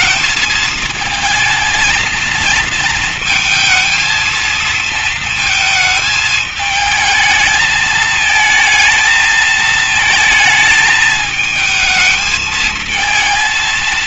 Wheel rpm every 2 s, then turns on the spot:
220, 230, 230, 220, 220, 220, 230.
none